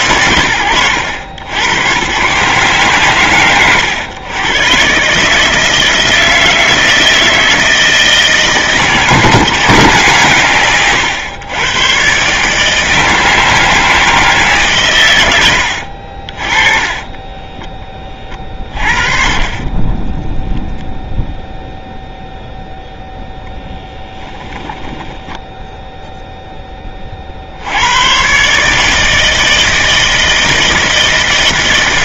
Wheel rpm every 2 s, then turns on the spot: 100, 140, 130, 160, 160, 130, 160, 140, 20, 40, 0, 0, 10, 20, 150, 160.
24-26